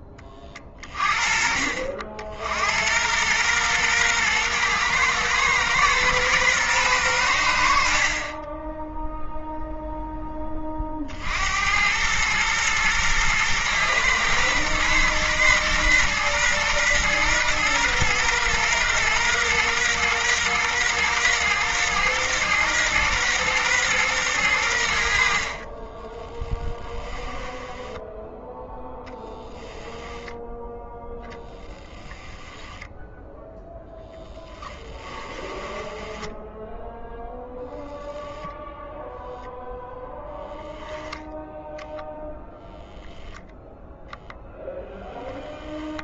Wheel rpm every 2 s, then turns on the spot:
40, 100, 120, 100, 0, 60, 120, 120, 120, 120, 120, 120, 70, 10, 0, 0, 0, 10, 10, 10, 10, 0, 0.
26-28 34-36 40-42